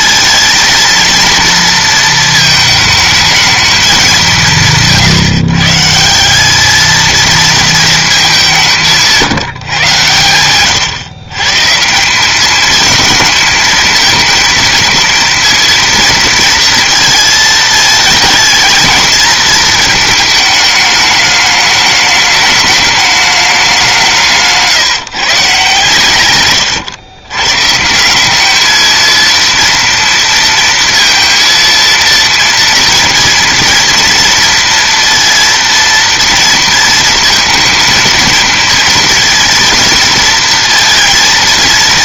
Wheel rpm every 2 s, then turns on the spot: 230, 220, 170, 200, 190, 110, 210, 220, 230, 220, 220, 210, 160, 120, 220, 230, 230, 230, 230, 230, 230.
none